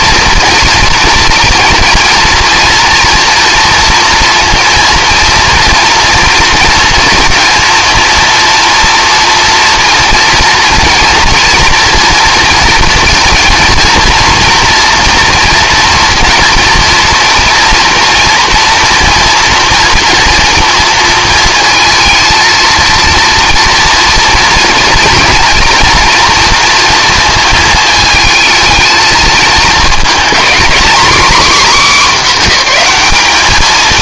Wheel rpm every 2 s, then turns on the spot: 230, 240, 230, 230, 240, 230, 230, 230, 230, 230, 230, 230, 230, 230, 220, 240, 220.
none